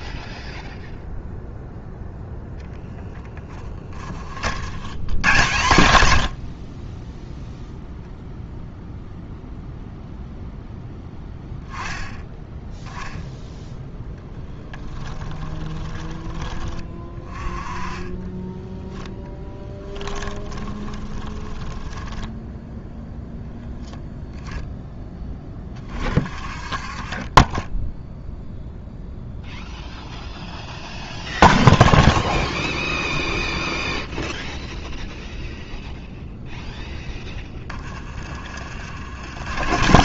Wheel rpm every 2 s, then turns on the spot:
0, 10, 80, 40, 0, 0, 10, 10, 20, 10, 20, 0, 10, 30, 0, 0, 0, 0, 0, 40.
14-16 18-22